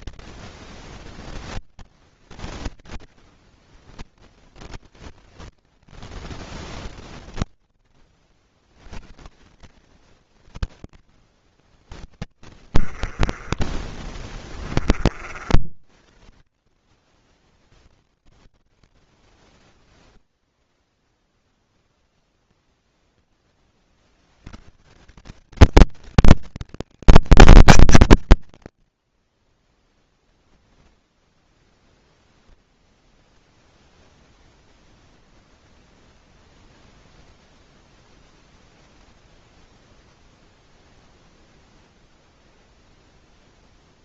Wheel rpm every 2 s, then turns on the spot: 40, 50, 30, 30, 70, 40, 20, 30, 30, 10, 0, 10, 180, 210, 50, 0, 0, 0, 0, 0, 0, 0.
0-8 10-14 18-20 28-30